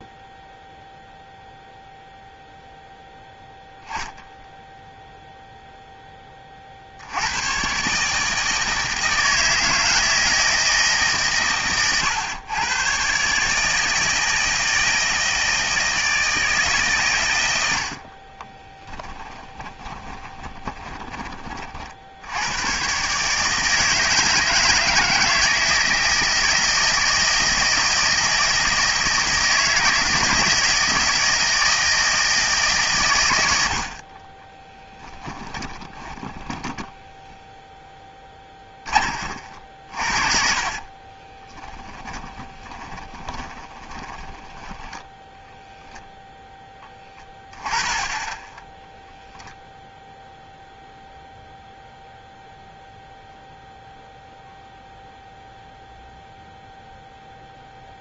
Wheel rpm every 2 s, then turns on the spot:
0, 0, 0, 40, 160, 160, 110, 160, 160, 30, 20, 100, 160, 160, 160, 160, 160, 20, 10, 20, 40, 20, 10, 0, 10, 0, 0, 0, 0.
18-22 34-38 40-44